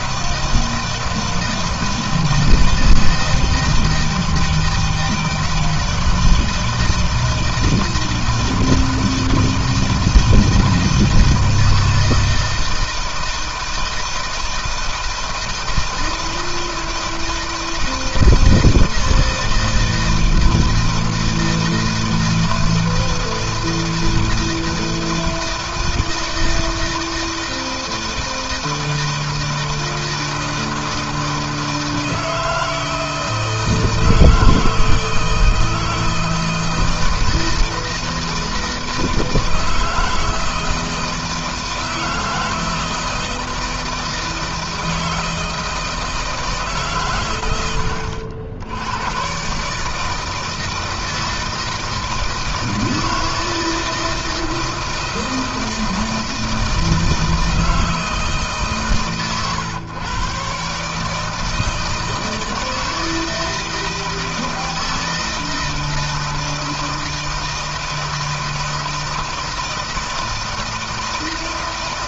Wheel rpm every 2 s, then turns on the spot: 160, 160, 160, 160, 160, 160, 160, 160, 160, 160, 160, 160, 160, 160, 160, 160, 160, 160, 160, 160, 160, 160, 160, 140, 90, 160, 160, 160, 160, 150, 140, 160, 160, 160, 160, 160.
none